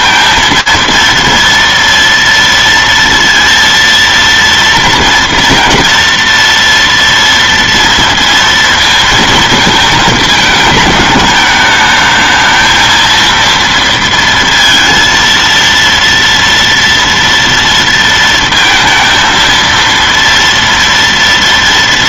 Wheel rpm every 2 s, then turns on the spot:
230, 230, 230, 240, 230, 220, 230, 230, 230, 230, 230.
none